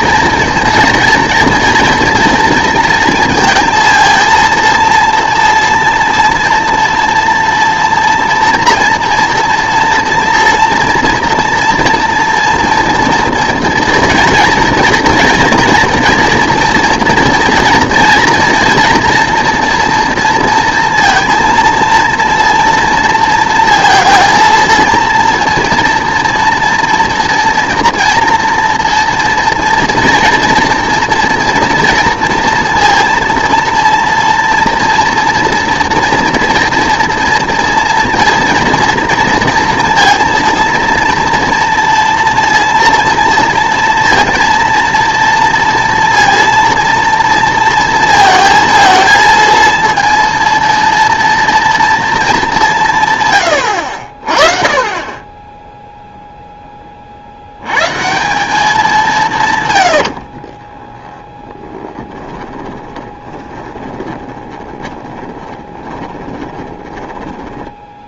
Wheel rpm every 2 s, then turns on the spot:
230, 230, 230, 230, 230, 230, 230, 230, 230, 230, 230, 230, 230, 230, 240, 230, 230, 230, 230, 230, 230, 230, 230, 230, 230, 230, 190, 30, 10, 190, 40, 20, 20, 20.
60-68